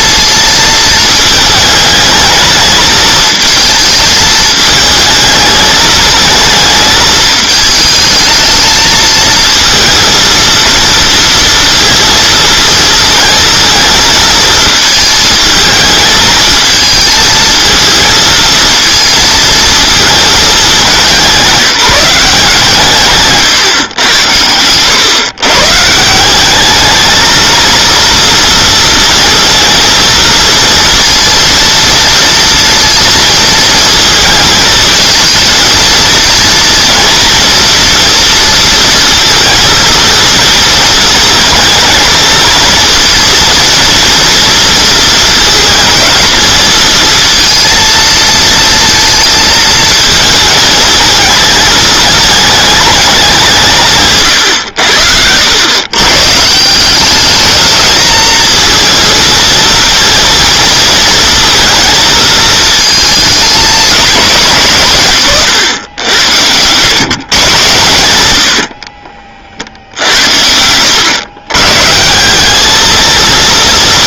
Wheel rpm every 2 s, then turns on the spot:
220, 220, 220, 220, 220, 230, 230, 220, 220, 230, 210, 150, 100, 200, 230, 230, 230, 220, 230, 230, 230, 230, 230, 220, 230, 220, 220, 110, 160, 230, 230, 220, 170, 110, 60, 90, 210.
68-70